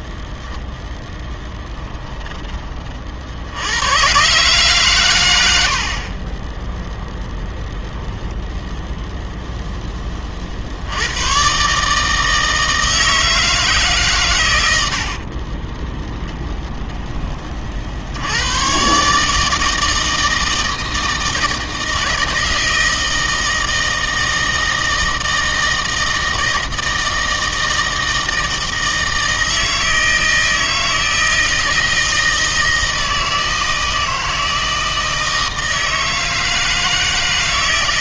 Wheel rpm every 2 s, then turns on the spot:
0, 20, 130, 20, 10, 40, 160, 120, 20, 100, 160, 160, 160, 160, 160, 160, 160, 160, 160.
16-18